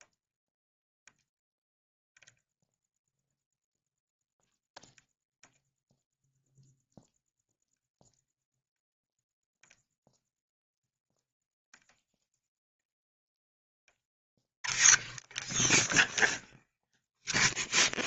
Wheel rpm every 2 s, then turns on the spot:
0, 0, 0, 0, 0, 0, 0, 0, 0.
none